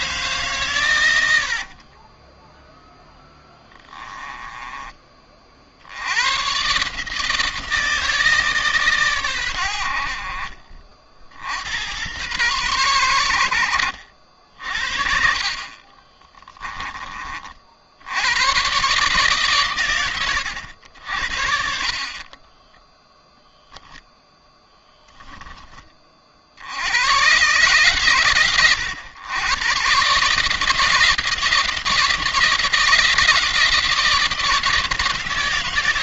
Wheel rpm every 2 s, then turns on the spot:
120, 0, 20, 140, 140, 50, 110, 60, 20, 120, 70, 10, 10, 90, 110, 160, 160, 160.
none